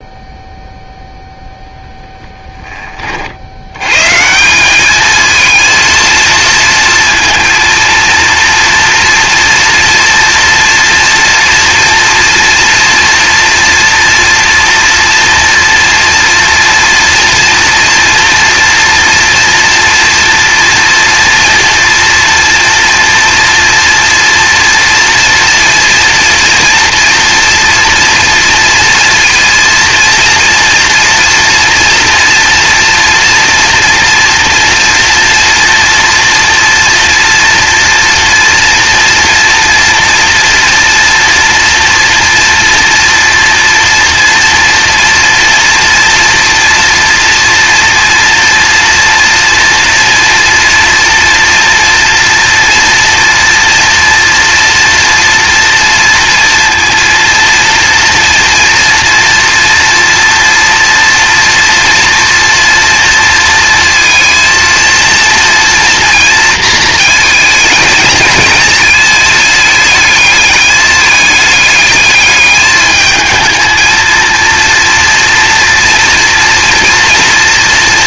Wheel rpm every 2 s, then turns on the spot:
0, 20, 210, 230, 230, 230, 230, 230, 230, 230, 230, 230, 240, 240, 230, 230, 230, 230, 230, 230, 230, 230, 230, 240, 230, 230, 240, 230, 230, 230, 230, 230, 230, 230, 220, 210, 210, 230, 240.
none